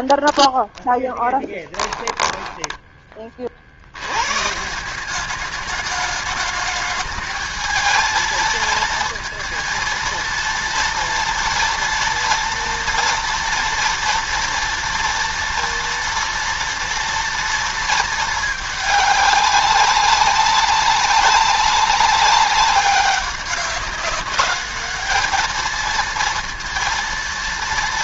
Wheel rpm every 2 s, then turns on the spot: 20, 10, 150, 210, 230, 230, 240, 230, 230, 210, 200, 200, 210, 230.
0-2